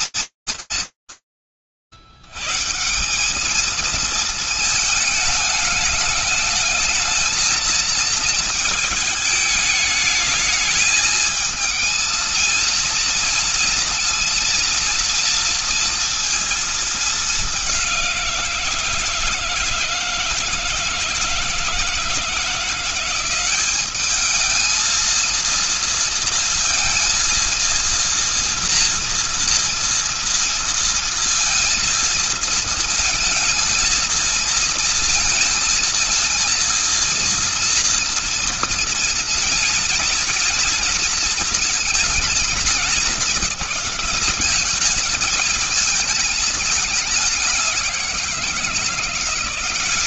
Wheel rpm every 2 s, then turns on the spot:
150, 130, 220, 210, 220, 220, 230, 230, 230, 170, 160, 170, 220, 230, 230, 230, 220, 230, 230, 230, 230, 220, 220, 210, 180.
none